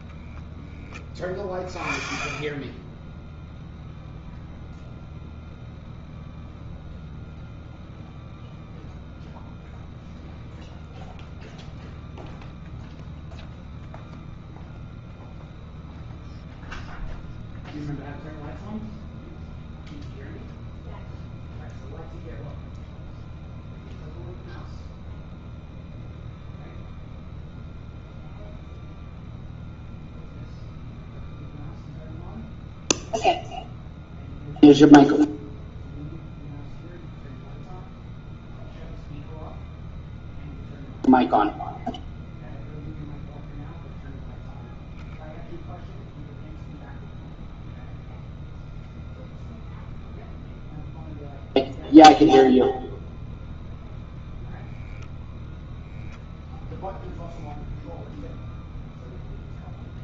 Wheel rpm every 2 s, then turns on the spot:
10, 10, 0, 0, 0, 0, 0, 0, 0, 0, 0, 0, 0, 0, 0, 0, 0, 0, 0, 0, 0, 0, 0, 0, 0, 0, 0, 0, 0, 0.
none